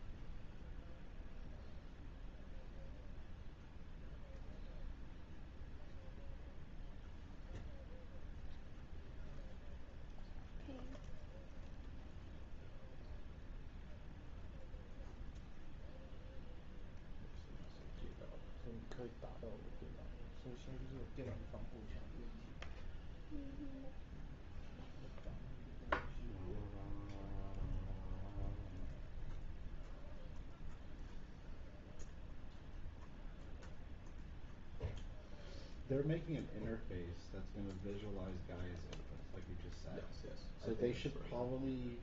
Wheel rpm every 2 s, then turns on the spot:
0, 0, 0, 0, 0, 0, 0, 0, 0, 0, 0, 0, 0, 0, 0, 0, 0, 0, 0, 0, 0.
none